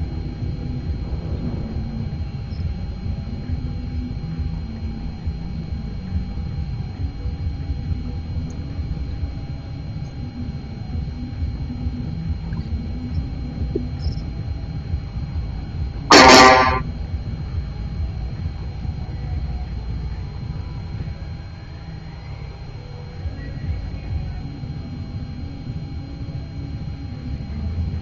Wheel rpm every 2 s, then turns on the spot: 0, 0, 0, 0, 0, 0, 0, 0, 0, 0, 0, 0, 0, 0.
none